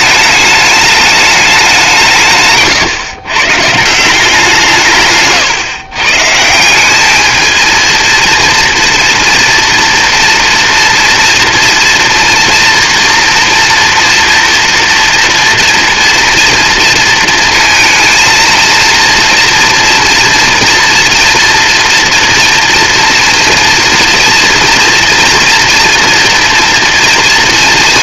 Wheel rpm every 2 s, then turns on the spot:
210, 130, 150, 200, 230, 230, 230, 230, 230, 230, 230, 230, 230, 230.
4-6